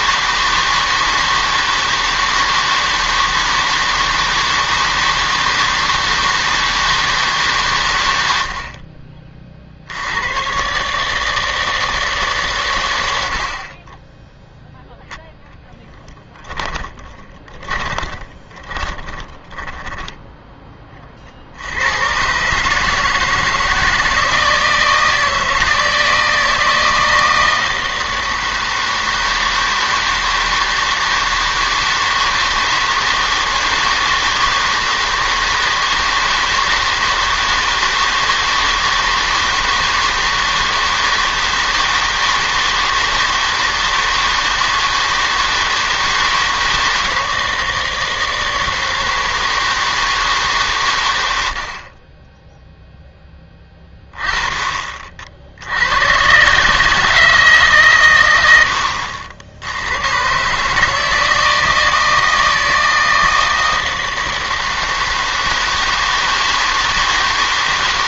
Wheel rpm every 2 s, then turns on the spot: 160, 160, 160, 160, 60, 130, 120, 0, 20, 20, 20, 150, 160, 160, 160, 160, 160, 160, 160, 160, 160, 160, 160, 160, 160, 130, 0, 30, 140, 90, 150, 160, 160, 160.
16-20